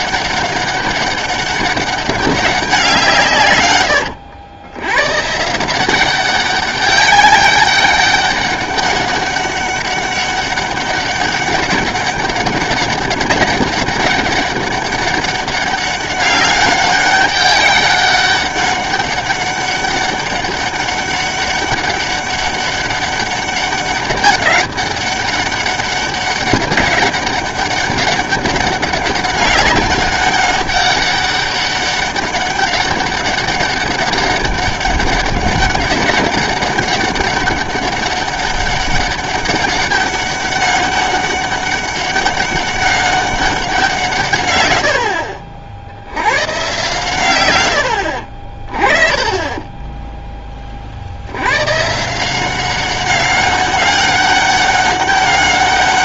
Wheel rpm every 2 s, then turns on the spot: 200, 190, 100, 190, 200, 200, 200, 200, 200, 200, 200, 200, 200, 200, 200, 200, 200, 200, 200, 200, 200, 200, 110, 130, 40, 30, 190, 200.
none